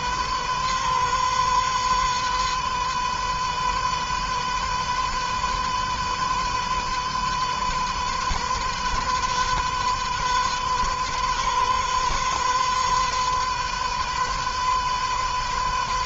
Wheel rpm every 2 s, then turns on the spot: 130, 130, 130, 130, 130, 130, 130, 130.
none